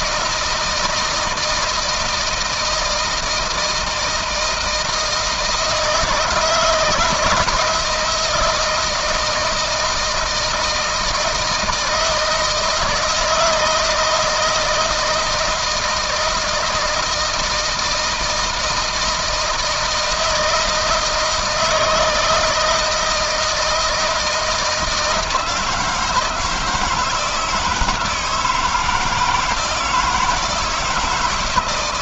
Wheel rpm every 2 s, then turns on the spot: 160, 160, 160, 170, 160, 160, 160, 160, 160, 160, 160, 160, 160, 160, 160, 170.
none